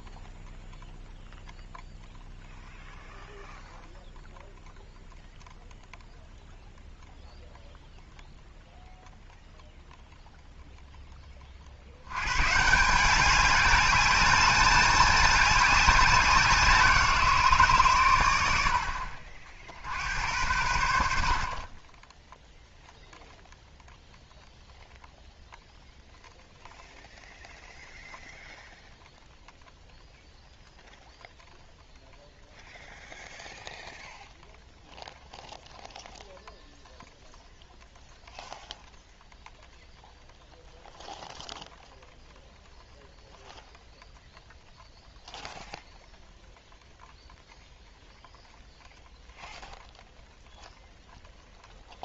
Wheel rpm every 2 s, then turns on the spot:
0, 0, 0, 0, 0, 0, 170, 210, 170, 60, 80, 0, 0, 0, 0, 0, 0, 0, 0, 0, 0, 0, 0, 0, 0, 0.
none